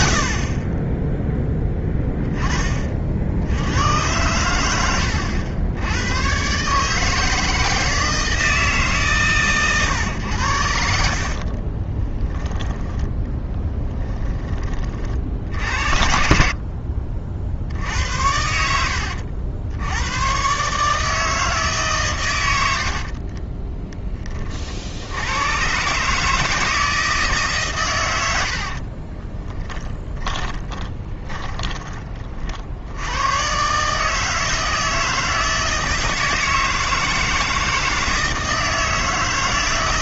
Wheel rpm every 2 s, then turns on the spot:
20, 30, 100, 140, 160, 80, 10, 30, 40, 80, 130, 80, 50, 160, 60, 20, 70, 160, 160, 160.
10-12 28-32